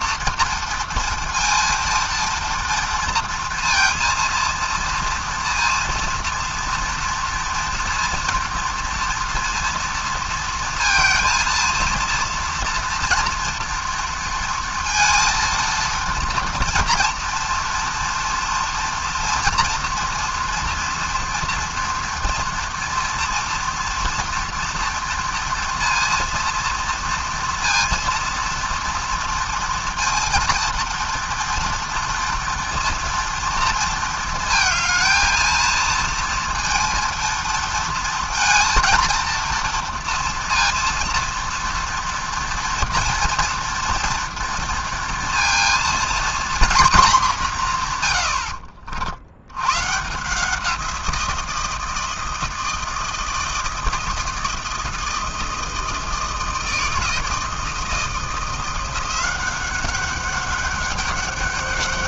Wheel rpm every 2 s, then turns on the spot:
230, 230, 230, 230, 230, 230, 230, 230, 230, 230, 230, 230, 230, 230, 230, 230, 230, 220, 230, 230, 230, 230, 230, 240, 70, 170, 160, 160, 160, 160, 200.
none